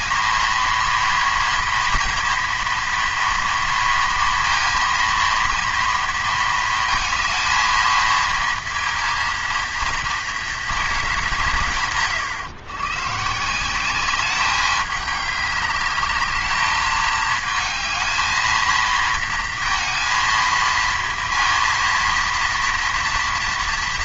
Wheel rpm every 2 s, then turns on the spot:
230, 230, 230, 230, 230, 220, 120, 200, 210, 230, 230, 230.
none